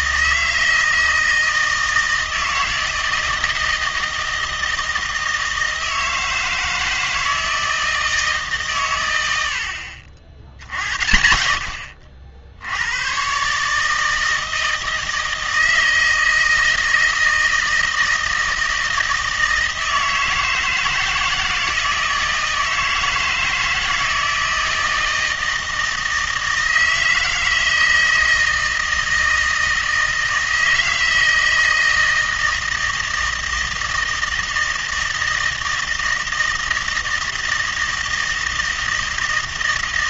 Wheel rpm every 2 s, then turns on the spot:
160, 160, 160, 160, 140, 80, 80, 160, 160, 160, 160, 160, 160, 160, 160, 160, 160, 160, 160, 160.
none